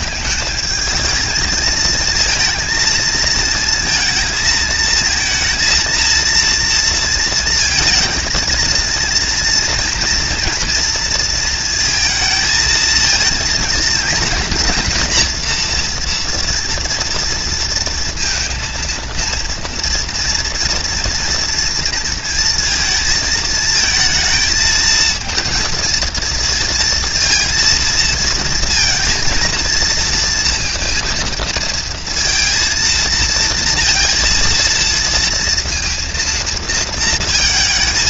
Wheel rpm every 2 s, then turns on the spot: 220, 230, 220, 230, 230, 230, 220, 240, 230, 230, 230, 230, 220, 230, 230, 230, 230, 230, 230.
none